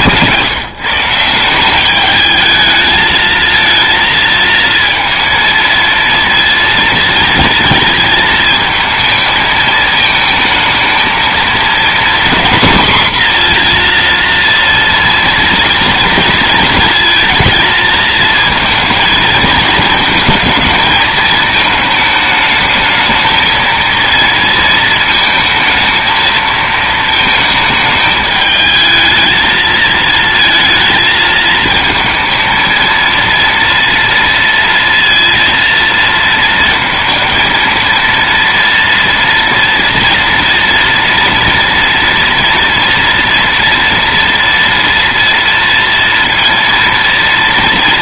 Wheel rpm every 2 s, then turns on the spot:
130, 220, 230, 230, 220, 220, 240, 230, 220, 220, 230, 220, 230, 220, 210, 220, 230, 230, 220, 230, 230, 230, 230, 230.
none